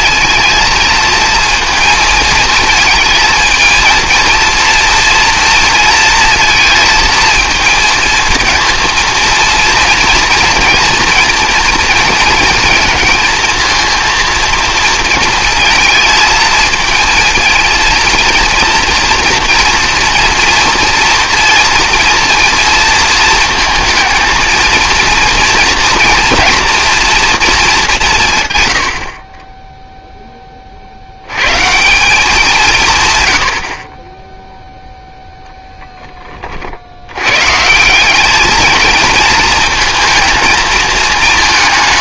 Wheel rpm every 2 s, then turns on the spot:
230, 230, 230, 230, 230, 230, 230, 230, 220, 240, 230, 230, 230, 230, 110, 40, 170, 0, 90, 220, 220.
none